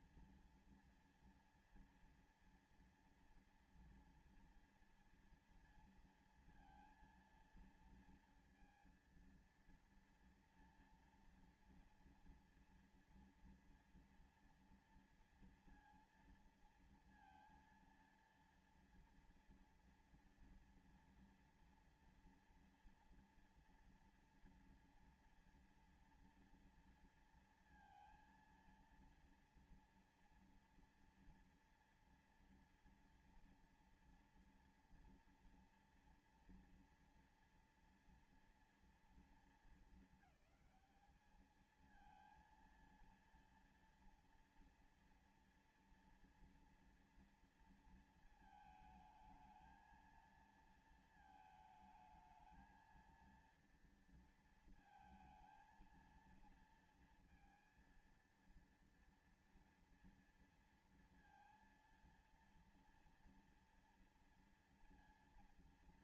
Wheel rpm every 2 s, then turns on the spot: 230, 230, 230, 230, 230, 230, 230, 230, 230, 230, 230, 230, 230, 230, 230, 230, 230, 230, 240, 230, 210, 230, 230, 230, 220, 230, 220, 230, 230, 230, 230, 230, 230.
none